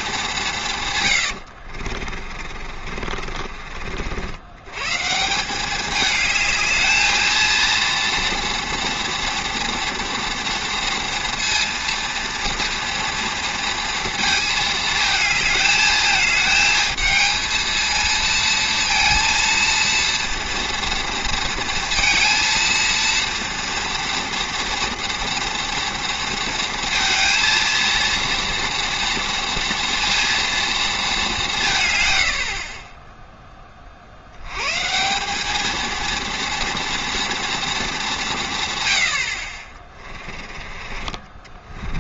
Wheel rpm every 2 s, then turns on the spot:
140, 40, 120, 220, 230, 230, 230, 220, 220, 230, 230, 230, 230, 230, 230, 220, 30, 120, 230, 120, 30.
2-4